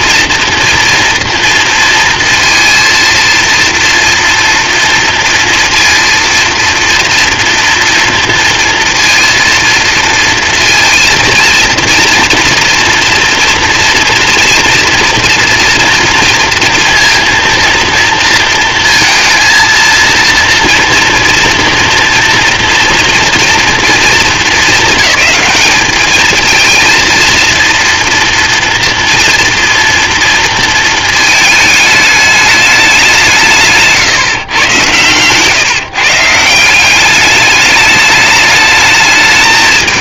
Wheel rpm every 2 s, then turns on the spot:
240, 230, 230, 230, 230, 230, 230, 230, 230, 230, 230, 230, 200, 230, 230, 230, 210, 120, 180, 210.
none